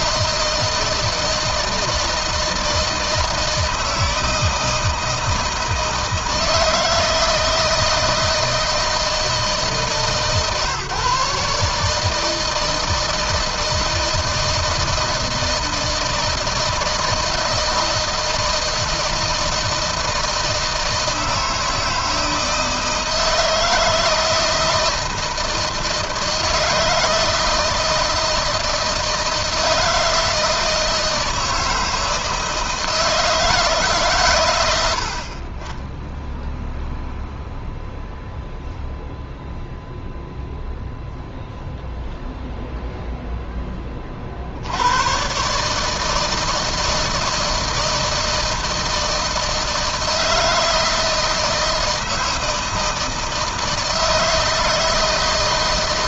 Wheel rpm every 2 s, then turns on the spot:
160, 160, 160, 160, 160, 140, 160, 160, 160, 160, 160, 160, 160, 160, 160, 160, 160, 70, 0, 0, 0, 0, 100, 160, 160, 160, 160, 160.
none